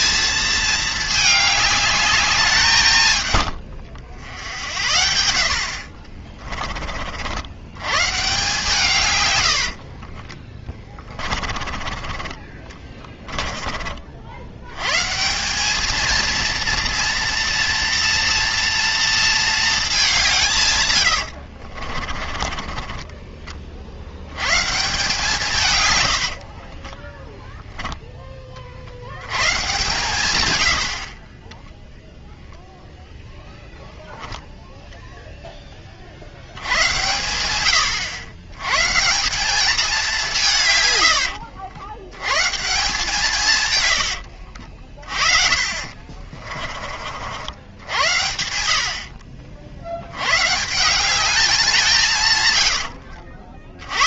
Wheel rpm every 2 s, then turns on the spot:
220, 170, 70, 30, 150, 20, 30, 110, 230, 230, 120, 30, 140, 30, 60, 80, 0, 0, 90, 150, 120, 150, 50, 40, 70, 160, 90.
10-14 20-24 26-28 44-46 52-54